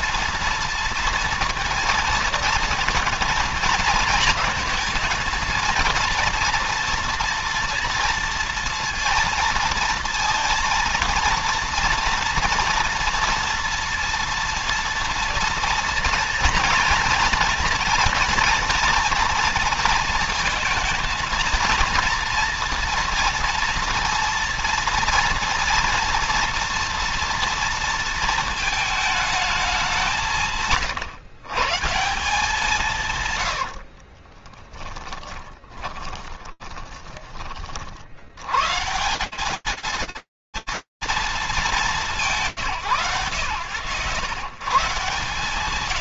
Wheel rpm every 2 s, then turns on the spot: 230, 230, 220, 230, 230, 230, 230, 230, 230, 240, 230, 230, 230, 230, 220, 160, 170, 40, 20, 120, 180, 120, 100.
34-38